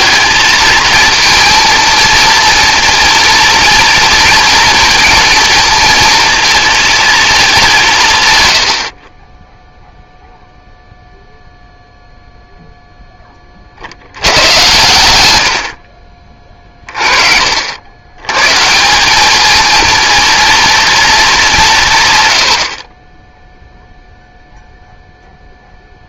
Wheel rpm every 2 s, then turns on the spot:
230, 230, 230, 230, 100, 0, 0, 100, 30, 140, 230, 60, 0.
none